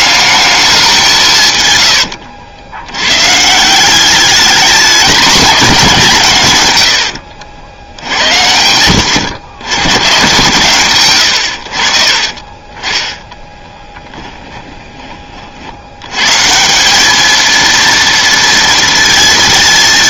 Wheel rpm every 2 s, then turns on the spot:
200, 80, 210, 110, 90, 130, 20, 10, 170, 230.
12-14